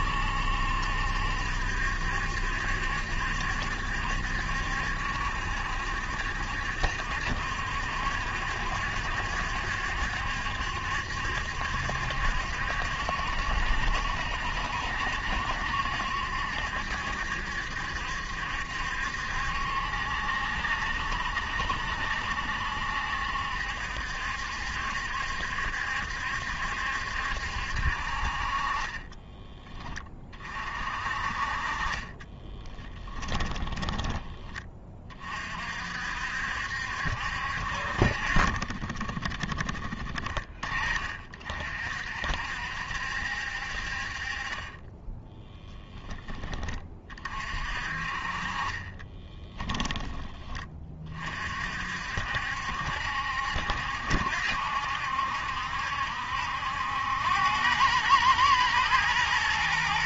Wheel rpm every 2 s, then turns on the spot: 70, 70, 70, 70, 70, 70, 70, 70, 70, 70, 70, 70, 70, 70, 20, 40, 30, 30, 70, 30, 30, 70, 20, 30, 30, 30, 70, 70, 90, 110.
28-30 32-34 48-50